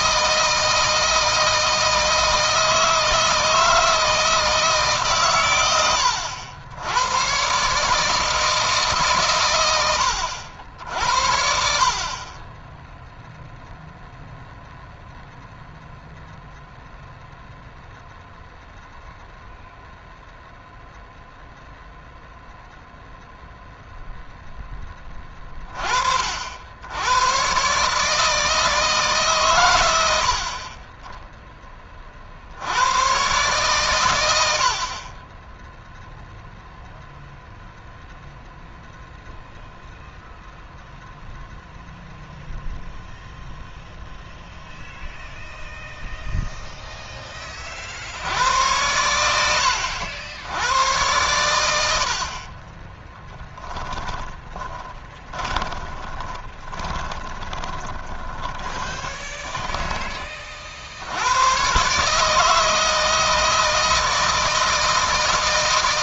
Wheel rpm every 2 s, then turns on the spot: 160, 160, 140, 90, 140, 70, 10, 0, 0, 0, 0, 0, 10, 90, 150, 20, 100, 50, 0, 0, 0, 0, 0, 0, 90, 100, 20, 30, 20, 20, 60, 160, 160.
52-60